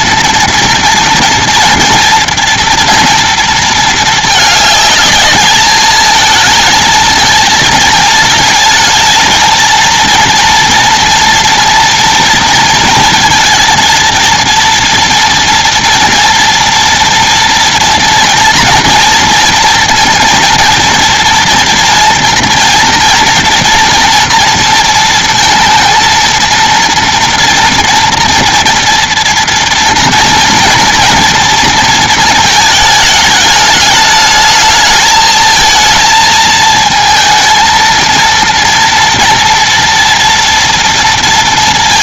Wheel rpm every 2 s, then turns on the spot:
230, 230, 210, 220, 220, 240, 230, 230, 230, 230, 230, 240, 230, 230, 240, 230, 210, 220, 220, 230, 230.
none